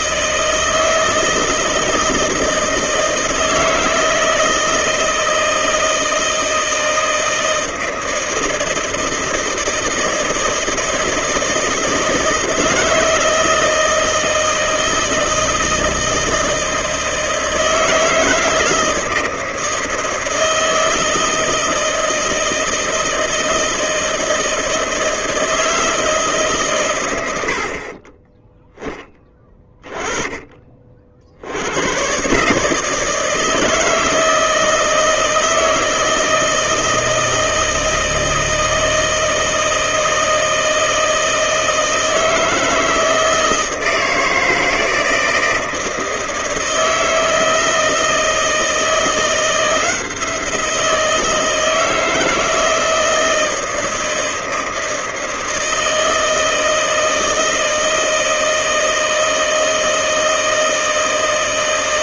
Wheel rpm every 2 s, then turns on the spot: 160, 160, 160, 160, 160, 160, 160, 160, 160, 160, 160, 160, 160, 130, 10, 40, 150, 160, 160, 160, 160, 160, 160, 160, 170, 170, 160, 160, 160, 160, 160.
none